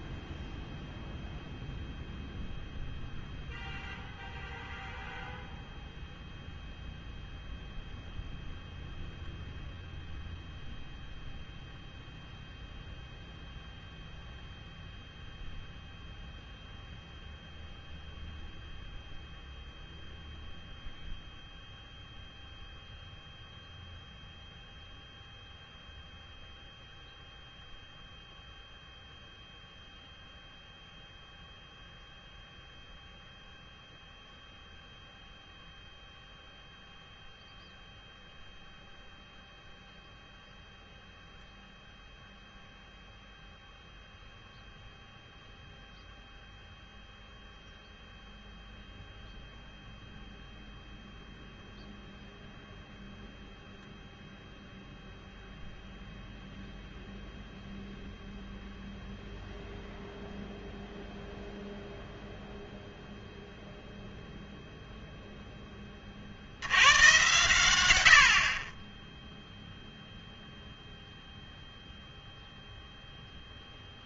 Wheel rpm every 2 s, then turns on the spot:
0, 0, 0, 0, 0, 0, 0, 0, 0, 0, 0, 0, 0, 0, 0, 0, 0, 0, 0, 0, 0, 0, 0, 0, 0, 0, 0, 0, 0, 0, 0, 0, 0, 90, 20, 0, 0.
none